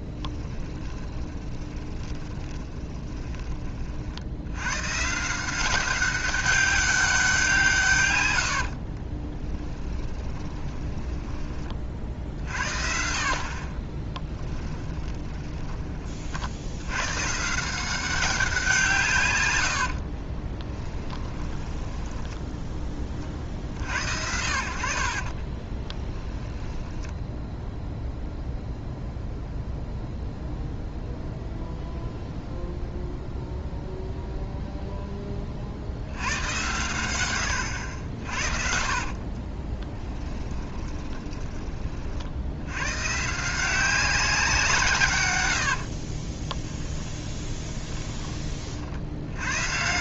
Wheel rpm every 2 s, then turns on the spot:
10, 20, 120, 200, 60, 20, 50, 10, 90, 170, 10, 10, 60, 10, 0, 0, 0, 0, 120, 40, 20, 100, 160, 20, 50.
0-4 8-12 14-16 20-22 26-28 38-42 46-48